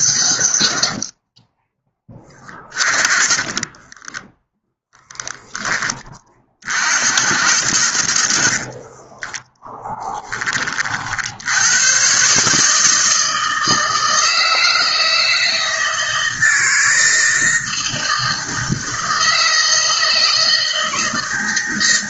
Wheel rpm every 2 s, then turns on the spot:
50, 30, 0, 60, 40, 40, 160, 160, 160, 160, 160.
8-10